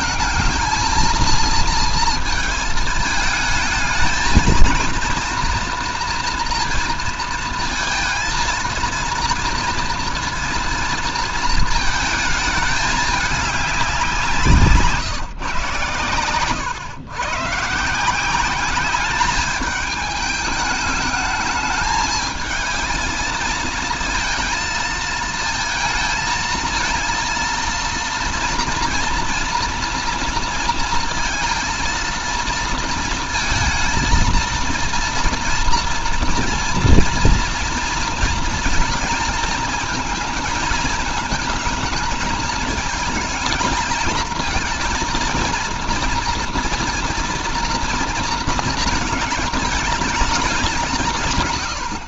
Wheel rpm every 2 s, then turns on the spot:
230, 220, 230, 230, 230, 230, 220, 160, 120, 190, 210, 220, 220, 230, 230, 230, 230, 230, 230, 230, 220, 220, 230, 230, 220, 200.
none